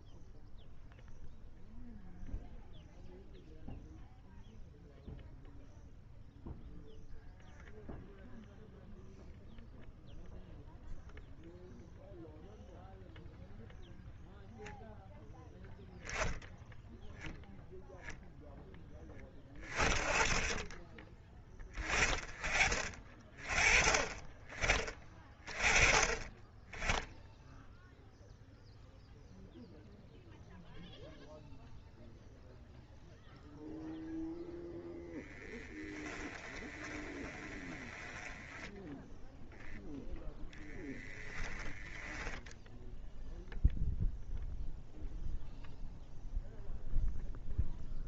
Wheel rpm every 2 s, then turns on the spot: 0, 0, 0, 0, 0, 0, 0, 0, 0, 20, 30, 30, 20, 10, 0, 0, 0, 10, 20, 10, 10, 0, 0, 0.
36-38 40-42